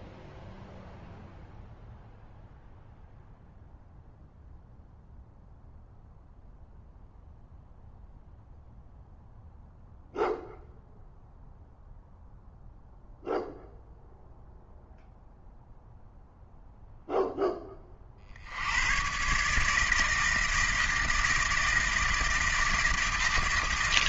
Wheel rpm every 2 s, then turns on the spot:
0, 0, 0, 0, 0, 0, 0, 0, 0, 90, 160, 160.
none